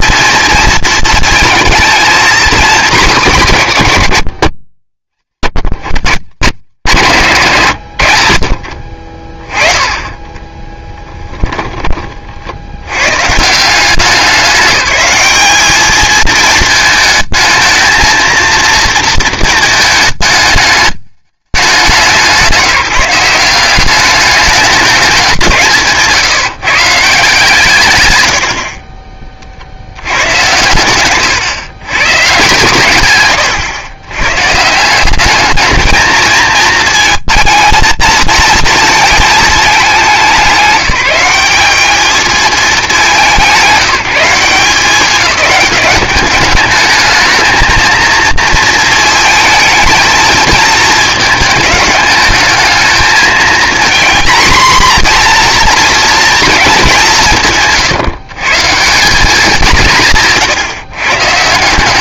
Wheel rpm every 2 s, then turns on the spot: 230, 210, 80, 150, 40, 10, 80, 200, 220, 230, 210, 180, 200, 160, 60, 110, 110, 160, 230, 230, 190, 210, 190, 210, 230, 220, 210, 240, 210, 160, 140.
10-12